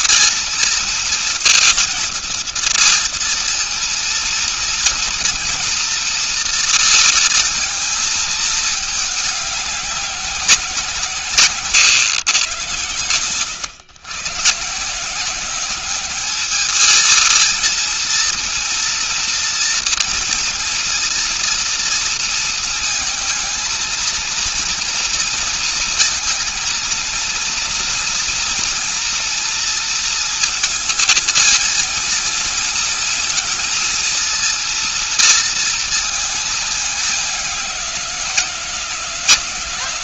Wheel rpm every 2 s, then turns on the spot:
230, 230, 230, 230, 220, 190, 120, 120, 210, 230, 230, 230, 230, 230, 230, 230, 230, 230, 220, 180.
none